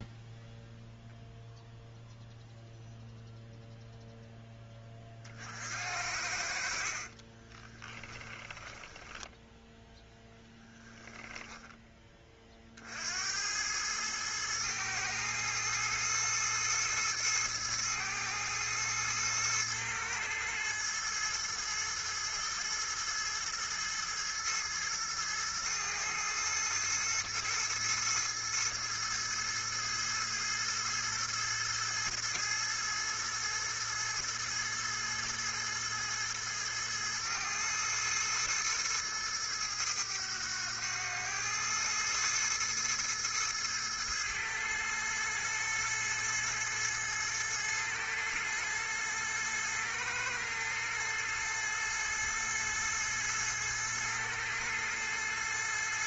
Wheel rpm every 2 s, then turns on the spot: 0, 0, 30, 50, 10, 10, 70, 110, 110, 110, 110, 110, 110, 110, 110, 110, 110, 110, 110, 110, 100, 110, 110, 110, 110, 110, 110, 110.
6-10